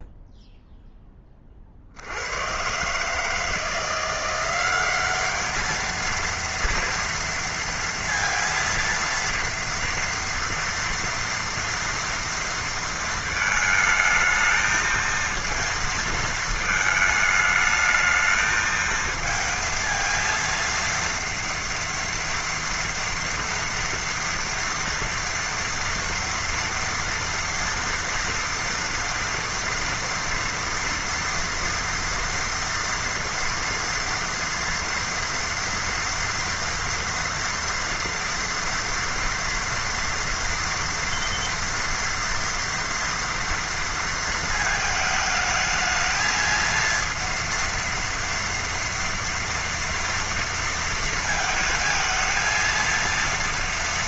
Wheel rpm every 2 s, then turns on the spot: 0, 100, 180, 230, 230, 230, 230, 220, 230, 220, 230, 230, 230, 230, 230, 230, 230, 230, 230, 230, 230, 230, 230, 220, 230, 230, 230.
none